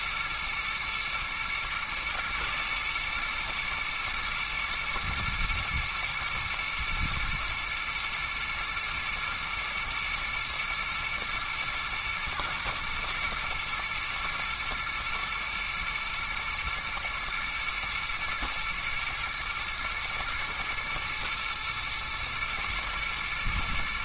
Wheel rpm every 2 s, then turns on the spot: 110, 120, 110, 110, 110, 120, 110, 120, 120, 120, 120, 110.
none